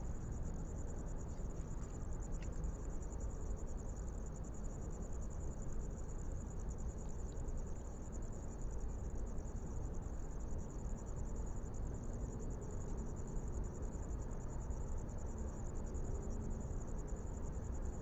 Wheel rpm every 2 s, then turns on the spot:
0, 0, 0, 0, 0, 0, 0, 0, 0.
none